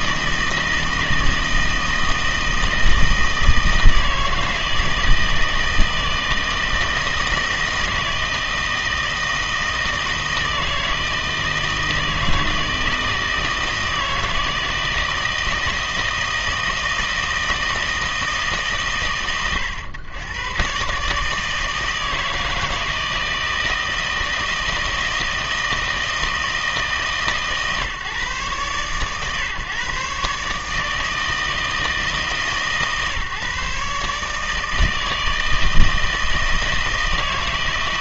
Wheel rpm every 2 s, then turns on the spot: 160, 160, 160, 160, 160, 160, 160, 160, 160, 140, 120, 160, 160, 160, 130, 150, 140, 160, 160.
none